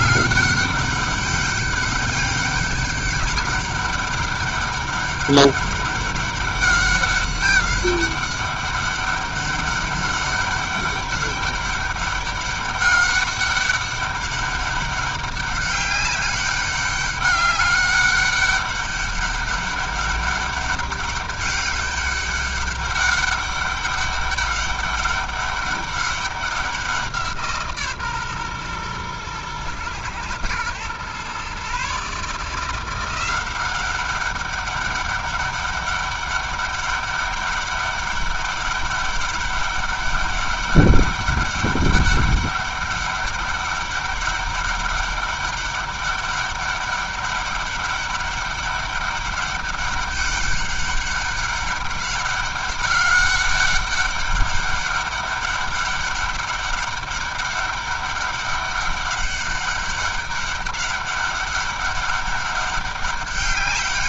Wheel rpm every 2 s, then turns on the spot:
200, 200, 200, 200, 200, 200, 200, 200, 200, 200, 200, 200, 200, 190, 130, 120, 160, 200, 200, 200, 200, 200, 200, 200, 200, 200, 200, 200, 200, 200, 200, 200.
none